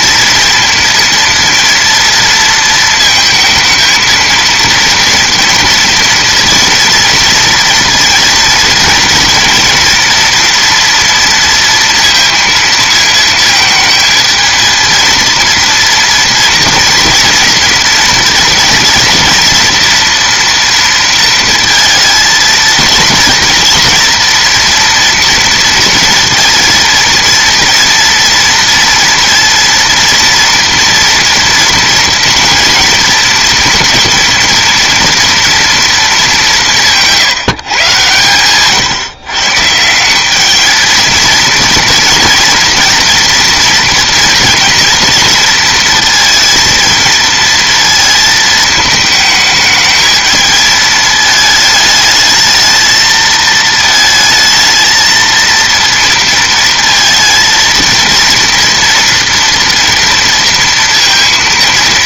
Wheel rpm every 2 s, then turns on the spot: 230, 230, 230, 230, 230, 230, 230, 230, 230, 230, 230, 230, 230, 230, 230, 230, 230, 230, 180, 140, 220, 240, 230, 230, 220, 220, 220, 220, 230, 230, 230.
none